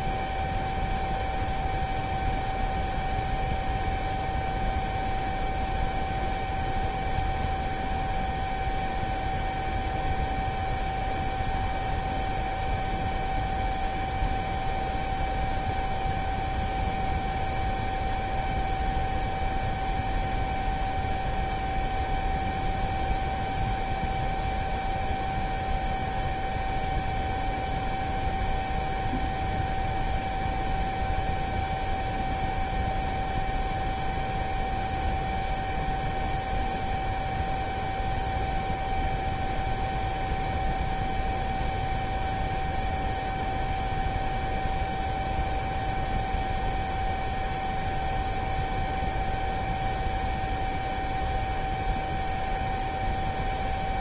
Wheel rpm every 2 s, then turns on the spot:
0, 0, 0, 0, 0, 0, 0, 0, 0, 0, 0, 0, 0, 0, 0, 0, 0, 0, 0, 0, 0, 0, 0, 0, 0, 0, 0.
none